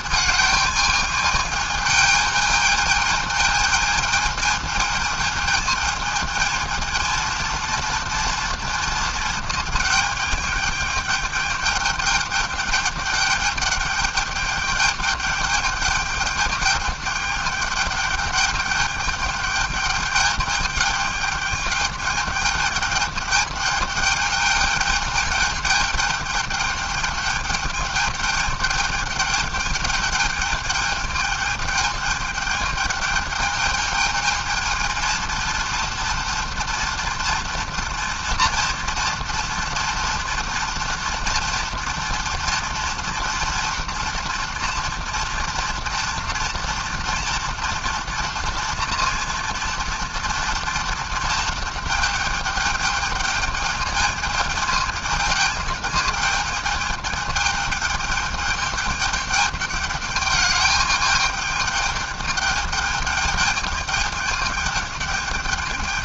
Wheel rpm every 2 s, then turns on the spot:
220, 220, 220, 220, 230, 210, 210, 200, 210, 210, 210, 210, 210, 210, 210, 210, 210, 220, 230, 230, 230, 230, 240, 240, 230, 230, 220, 220, 220, 210, 220, 210, 210.
none